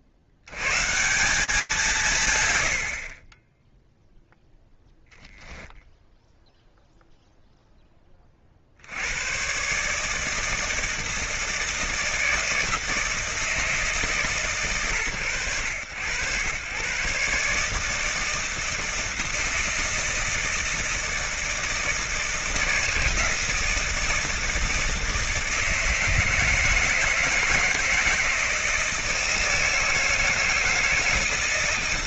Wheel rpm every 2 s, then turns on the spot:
50, 100, 10, 0, 70, 160, 160, 120, 130, 160, 160, 160, 160, 160, 170, 160.
none